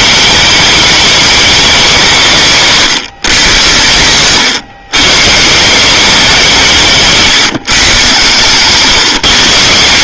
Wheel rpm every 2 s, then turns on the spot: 220, 150, 120, 180, 140.
none